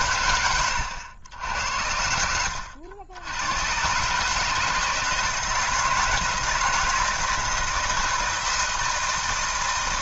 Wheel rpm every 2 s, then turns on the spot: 100, 80, 160, 160, 160.
2-4